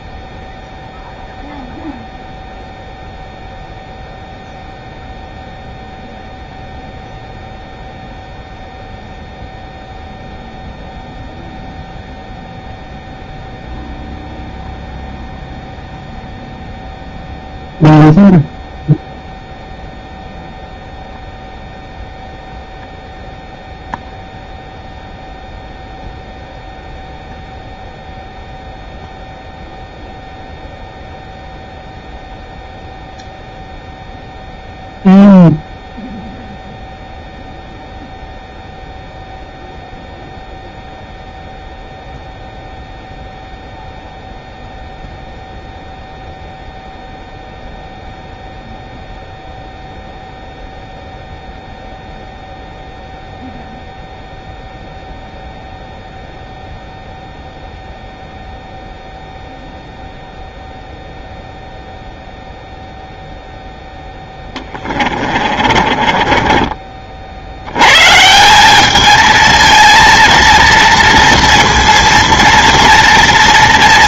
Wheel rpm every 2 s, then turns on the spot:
0, 0, 0, 0, 0, 0, 0, 0, 0, 0, 0, 0, 0, 0, 0, 0, 0, 0, 0, 0, 0, 0, 0, 0, 0, 0, 0, 0, 0, 0, 0, 0, 20, 40, 200, 230, 230.
64-66